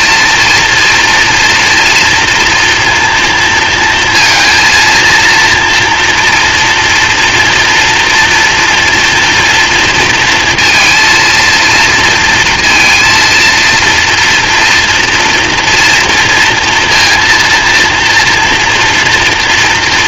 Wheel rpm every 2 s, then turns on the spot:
240, 240, 230, 230, 230, 230, 230, 230, 230, 230.
none